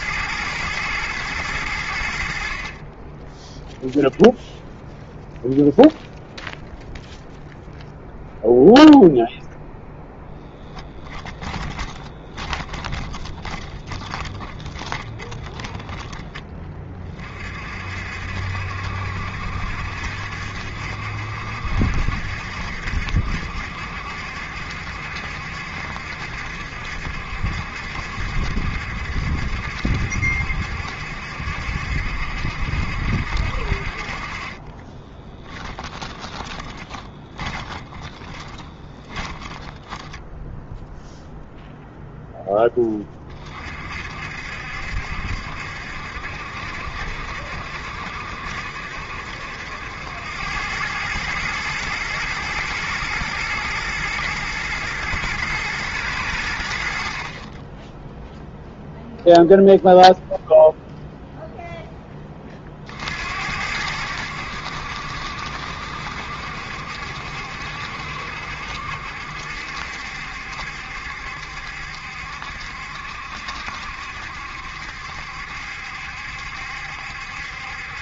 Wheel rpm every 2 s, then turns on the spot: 110, 20, 0, 0, 0, 10, 20, 30, 30, 70, 70, 70, 70, 70, 70, 70, 70, 20, 20, 20, 0, 20, 70, 70, 70, 100, 110, 110, 70, 0, 0, 50, 70, 70, 70, 70, 70, 70, 70.
10-16 34-40